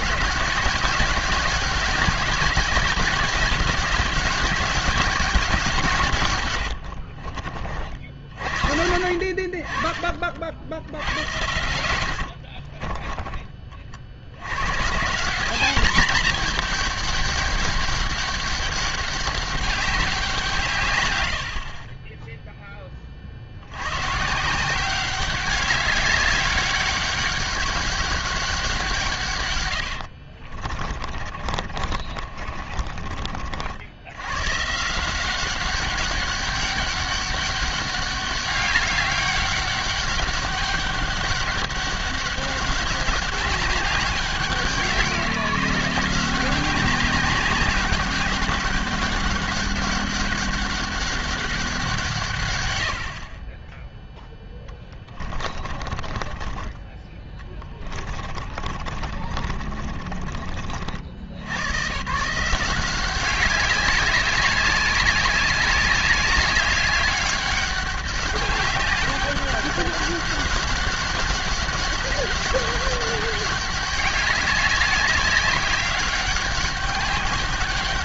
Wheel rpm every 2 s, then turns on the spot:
200, 200, 190, 100, 50, 70, 50, 140, 210, 200, 140, 20, 180, 200, 180, 40, 40, 130, 200, 200, 200, 200, 180, 190, 200, 200, 110, 20, 20, 40, 50, 180, 200, 200, 200, 200, 200, 190, 200.
6-8 12-14 30-34 54-60